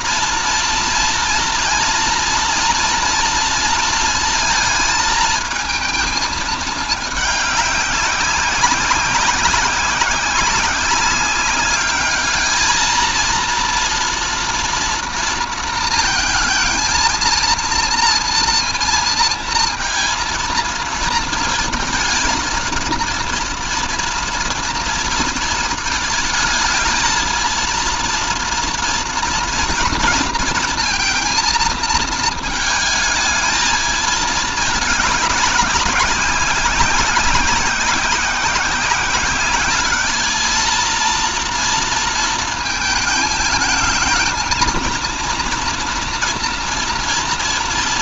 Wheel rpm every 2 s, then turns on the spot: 230, 230, 220, 220, 190, 190, 220, 230, 230, 230, 230, 230, 230, 220, 230, 230, 220, 210, 200, 190, 220, 220, 230, 230.
none